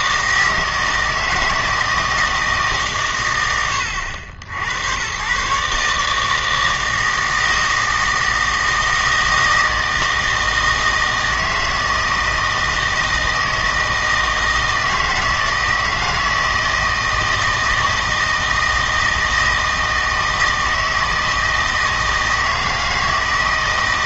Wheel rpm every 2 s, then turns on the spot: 160, 150, 80, 160, 160, 160, 160, 160, 160, 160, 160, 160.
none